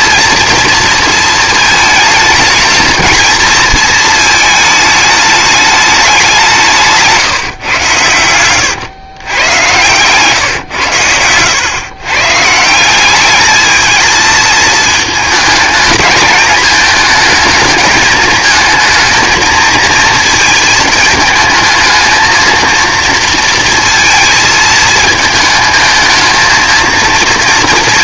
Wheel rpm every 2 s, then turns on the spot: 230, 220, 220, 160, 120, 130, 170, 220, 220, 220, 220, 230, 220, 220.
none